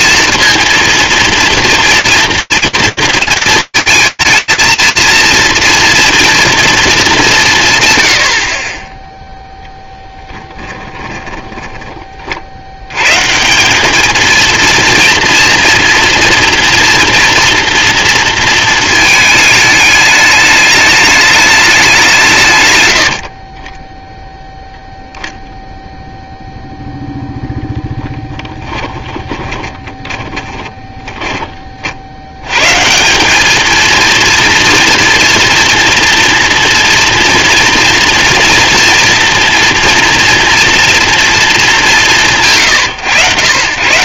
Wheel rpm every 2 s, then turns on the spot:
230, 240, 220, 230, 90, 10, 70, 230, 230, 220, 210, 130, 0, 0, 10, 10, 170, 230, 240, 230, 240, 140.
10-12 28-32